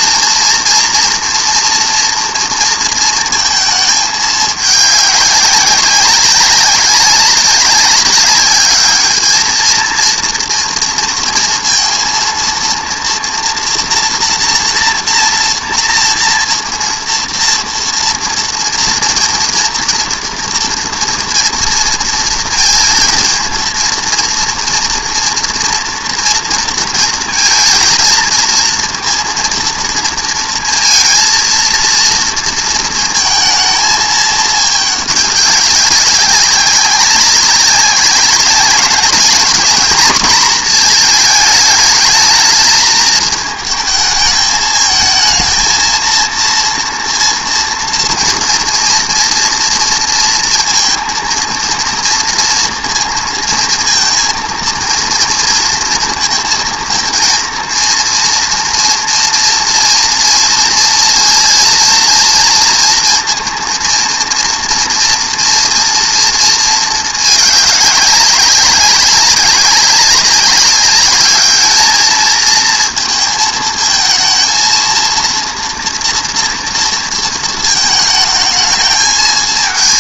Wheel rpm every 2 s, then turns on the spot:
230, 230, 200, 200, 210, 240, 230, 240, 230, 240, 230, 230, 230, 230, 230, 230, 230, 210, 190, 200, 230, 210, 220, 230, 230, 230, 230, 230, 230, 240, 230, 230, 230, 220, 200, 200, 220, 230, 230, 220.
none